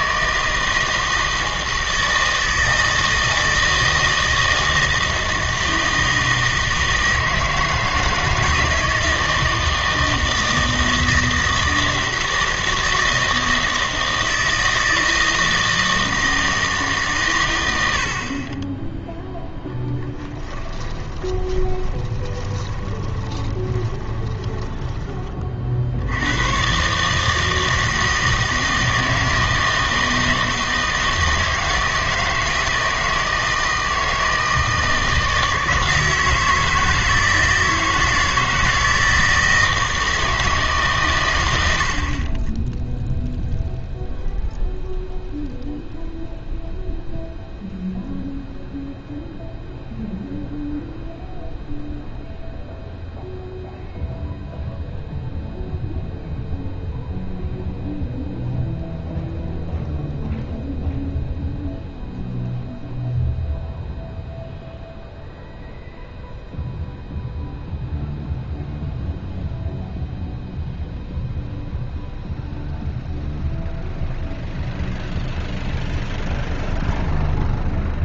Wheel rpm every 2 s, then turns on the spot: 160, 160, 160, 160, 160, 160, 160, 160, 160, 20, 20, 10, 10, 120, 160, 160, 160, 160, 160, 160, 150, 10, 0, 0, 0, 0, 0, 0, 0, 0, 0, 0, 0, 0, 0, 0, 0, 0, 0.
20-26